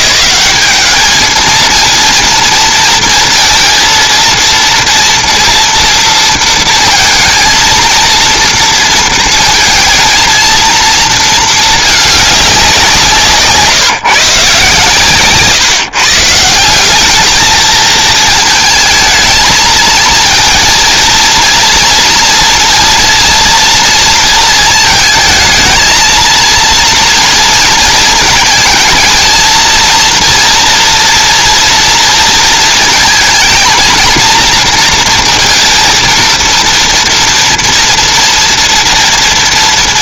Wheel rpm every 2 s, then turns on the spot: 210, 230, 230, 230, 230, 230, 190, 140, 170, 220, 230, 230, 230, 230, 230, 240, 230, 230, 230, 230.
none